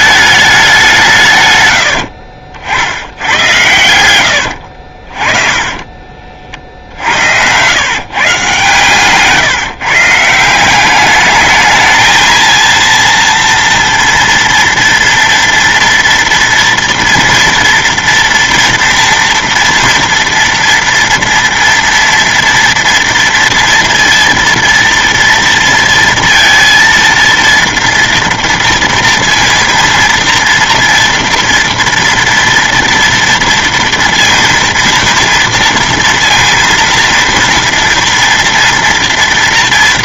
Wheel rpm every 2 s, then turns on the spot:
200, 60, 60, 50, 130, 190, 230, 230, 230, 240, 230, 230, 230, 230, 230, 230, 230, 230, 230, 230.
4-6